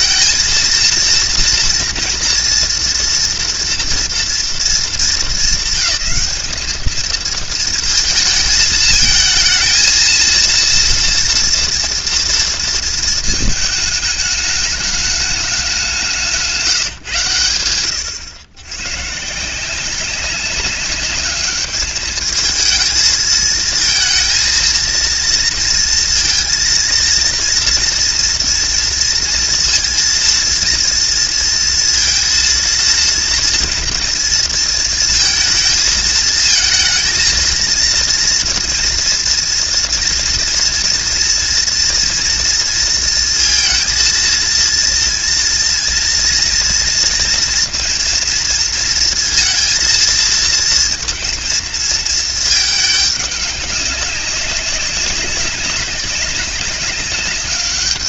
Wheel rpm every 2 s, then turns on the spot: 230, 240, 220, 210, 220, 230, 230, 210, 160, 120, 200, 220, 230, 230, 230, 230, 230, 230, 220, 230, 230, 230, 230, 230, 230, 230, 210, 200, 200.
none